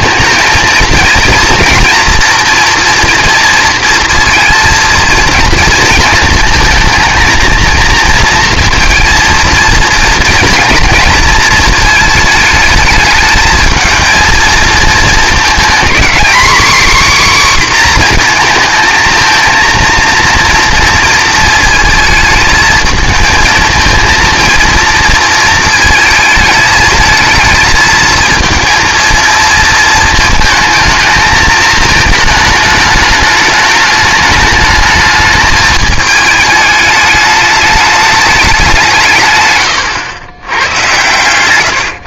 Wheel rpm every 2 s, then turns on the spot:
230, 240, 230, 220, 230, 230, 210, 230, 270, 230, 230, 220, 230, 220, 230, 220, 210, 210, 220, 190, 100.
none